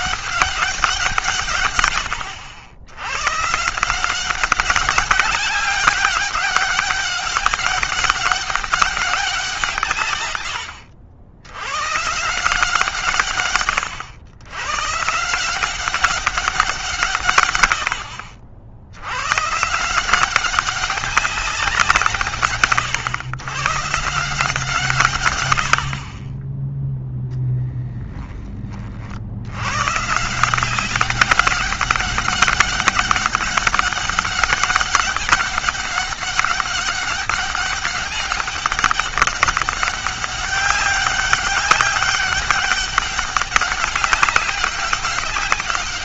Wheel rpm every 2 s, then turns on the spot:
180, 100, 190, 200, 190, 80, 160, 130, 160, 80, 190, 130, 150, 10, 40, 180, 200, 200, 200, 200, 200, 200, 200.
none